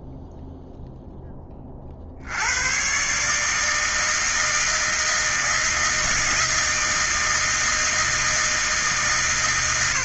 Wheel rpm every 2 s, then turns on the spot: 0, 90, 160, 160, 160.
none